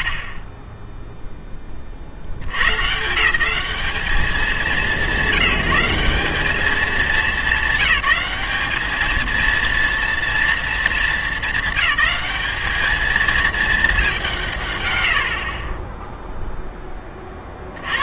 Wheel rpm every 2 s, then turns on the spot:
40, 130, 200, 210, 210, 230, 220, 120, 10.
0-2